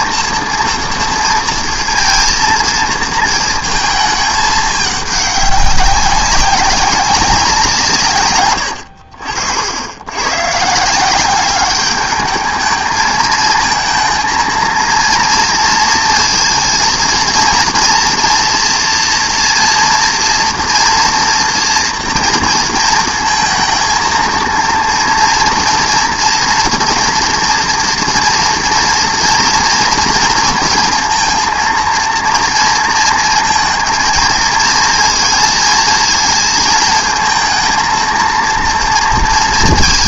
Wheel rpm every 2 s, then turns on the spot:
230, 230, 210, 190, 100, 140, 220, 230, 230, 240, 230, 230, 230, 230, 230, 230, 230, 230, 220, 230.
none